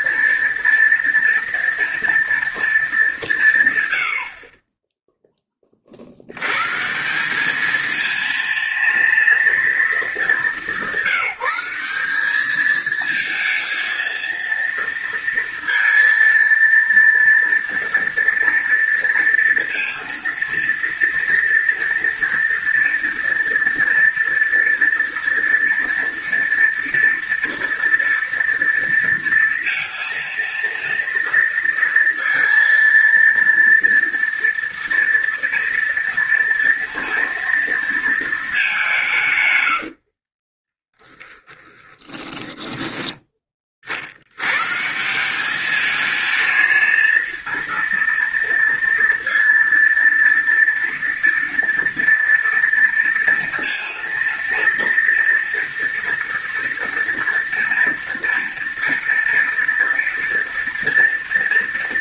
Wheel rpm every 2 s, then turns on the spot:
230, 230, 40, 100, 230, 210, 200, 230, 230, 230, 230, 230, 230, 240, 230, 230, 230, 230, 230, 220, 40, 10, 100, 220, 230, 230, 230, 230, 230, 230, 230.
40-42